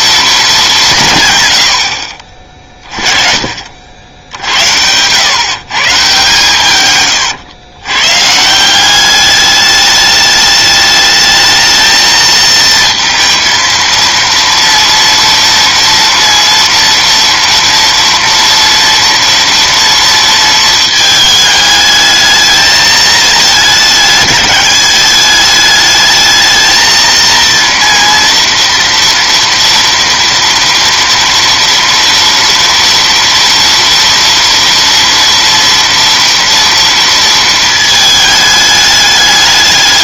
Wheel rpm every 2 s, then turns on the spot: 210, 30, 90, 140, 160, 210, 230, 230, 230, 230, 220, 220, 210, 220, 240, 230, 230, 230, 230, 210.
none